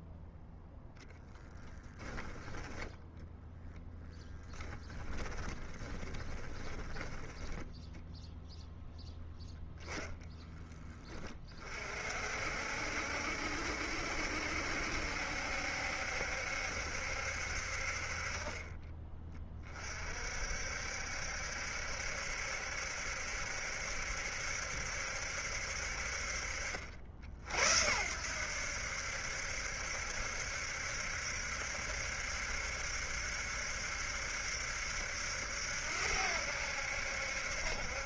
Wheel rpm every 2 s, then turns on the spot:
0, 10, 10, 20, 0, 20, 60, 70, 70, 30, 60, 70, 70, 50, 80, 70, 70, 70, 80.
4-8 10-12